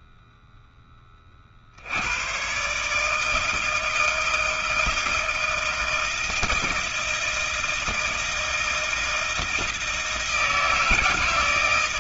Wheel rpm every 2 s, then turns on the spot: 10, 130, 160, 160, 160, 160.
none